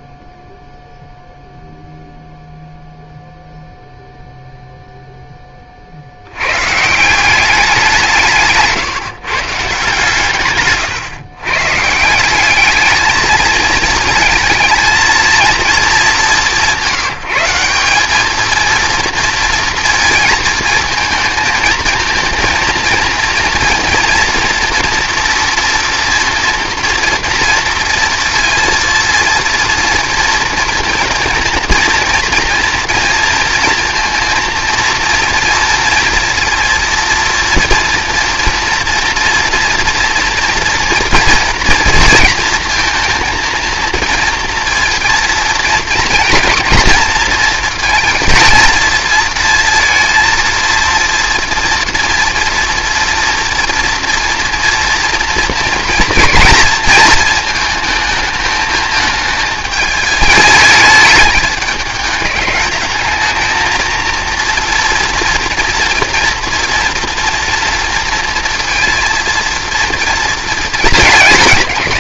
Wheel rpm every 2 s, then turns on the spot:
0, 0, 0, 130, 150, 140, 210, 230, 180, 220, 230, 230, 230, 230, 230, 230, 230, 230, 230, 240, 230, 230, 230, 230, 230, 230, 230, 230, 220, 220, 210, 210, 230, 230, 230, 220.
none